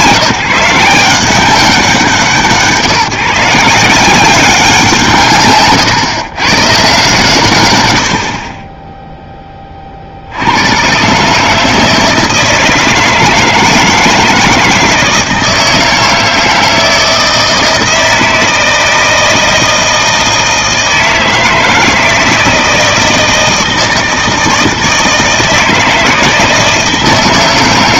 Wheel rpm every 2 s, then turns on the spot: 160, 150, 160, 140, 20, 100, 160, 160, 160, 160, 160, 160, 160, 160.
none